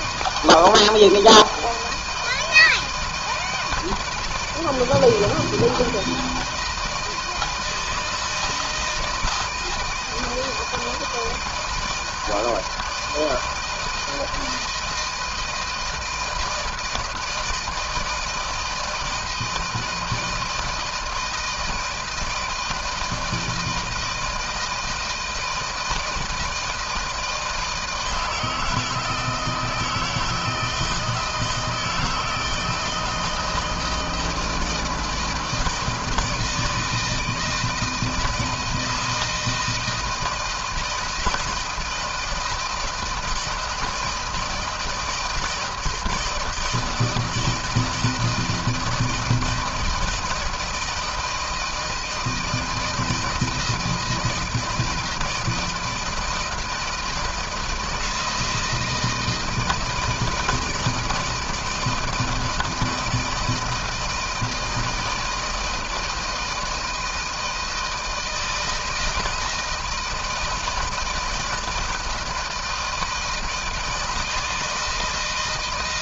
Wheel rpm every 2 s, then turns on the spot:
160, 160, 160, 160, 160, 160, 160, 160, 170, 160, 160, 160, 160, 160, 160, 160, 160, 160, 160, 170, 170, 160, 160, 160, 160, 160, 160, 160, 160, 160, 160, 160, 160, 160, 170, 160, 160, 160.
none